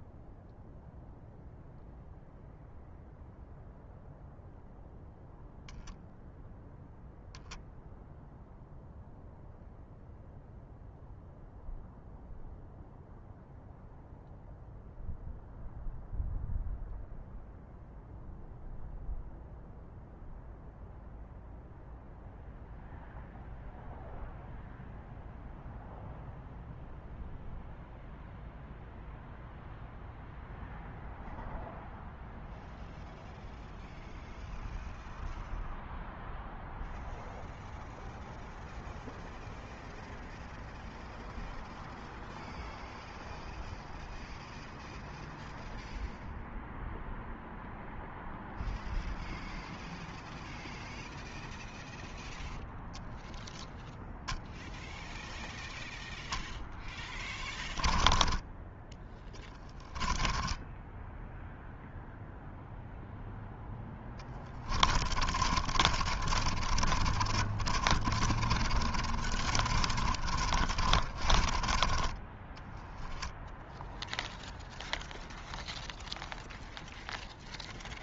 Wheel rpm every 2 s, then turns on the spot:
0, 0, 0, 0, 0, 0, 0, 0, 0, 0, 0, 0, 0, 0, 0, 0, 0, 0, 0, 0, 0, 0, 0, 0, 0, 0, 0, 0, 0, 10, 10, 0, 20, 30, 40, 40, 20, 0, 0.
58-62 64-72